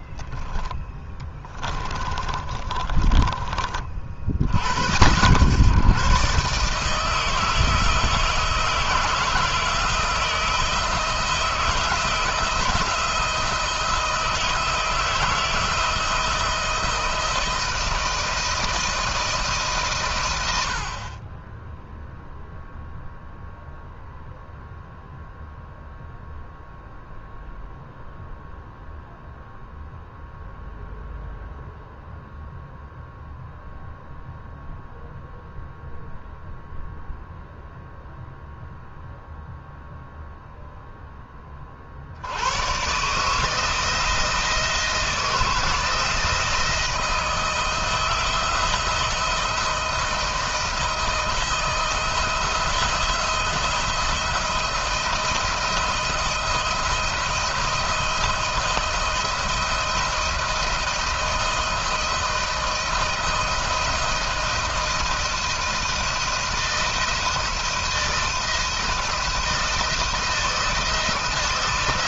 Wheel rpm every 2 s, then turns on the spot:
10, 30, 90, 160, 160, 160, 170, 160, 160, 160, 60, 0, 0, 0, 0, 0, 0, 0, 0, 0, 10, 130, 160, 160, 160, 160, 170, 170, 170, 160, 170, 160, 160, 170, 160, 160.
0-4